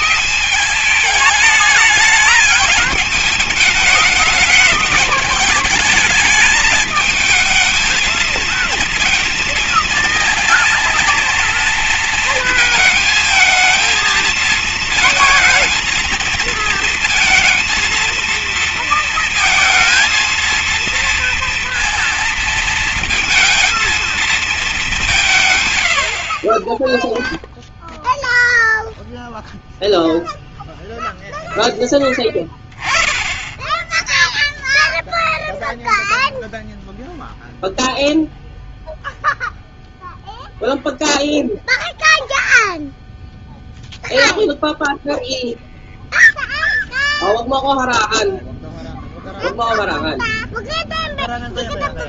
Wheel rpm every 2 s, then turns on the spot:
210, 210, 210, 210, 220, 230, 230, 230, 230, 230, 230, 230, 190, 10, 0, 0, 10, 0, 0, 0, 0, 0, 0, 0, 0, 0.
none